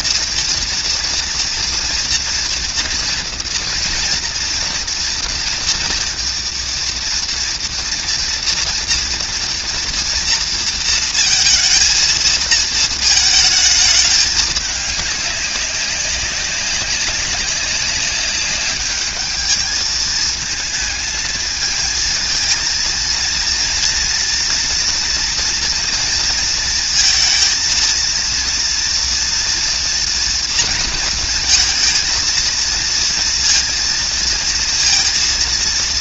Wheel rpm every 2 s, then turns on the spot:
230, 230, 230, 230, 240, 230, 220, 210, 190, 200, 220, 220, 230, 230, 230, 230, 230, 230.
none